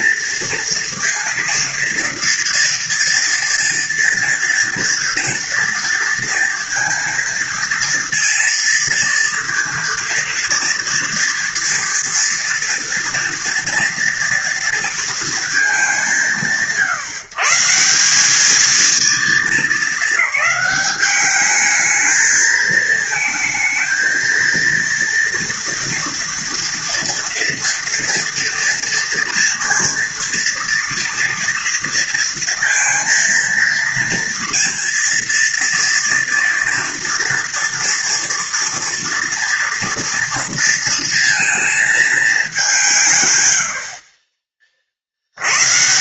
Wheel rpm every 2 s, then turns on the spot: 230, 230, 240, 230, 230, 230, 230, 230, 150, 220, 210, 220, 230, 230, 230, 230, 230, 230, 230, 230, 230, 170, 50.
none